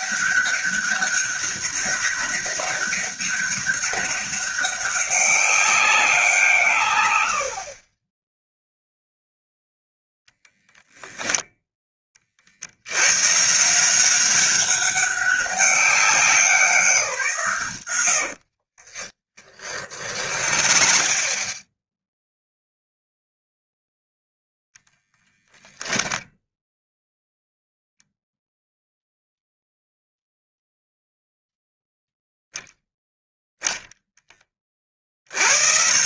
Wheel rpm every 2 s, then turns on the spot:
200, 190, 200, 140, 0, 0, 80, 200, 180, 40, 40, 0, 20, 10, 0, 0, 0, 30.
18-22 24-26